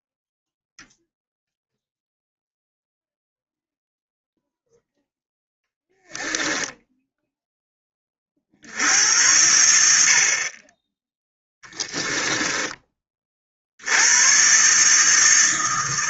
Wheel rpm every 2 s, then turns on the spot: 0, 0, 0, 10, 60, 30, 10, 130.
none